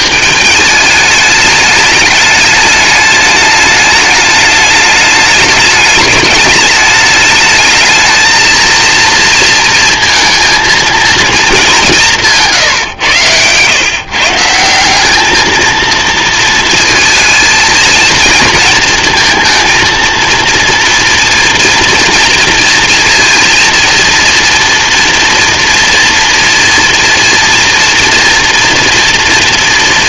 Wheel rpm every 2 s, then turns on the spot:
210, 210, 210, 200, 230, 230, 150, 180, 220, 220, 230, 230, 230, 230, 230.
none